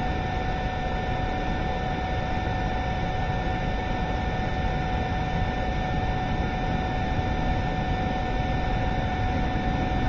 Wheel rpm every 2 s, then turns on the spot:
0, 0, 0, 0, 0.
none